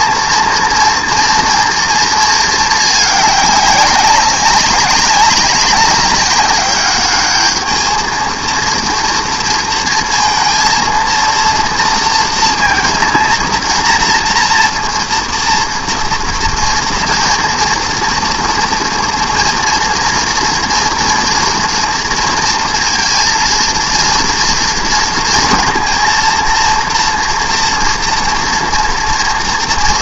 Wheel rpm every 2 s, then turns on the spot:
230, 210, 200, 200, 230, 230, 230, 240, 240, 230, 230, 230, 230, 230, 230.
none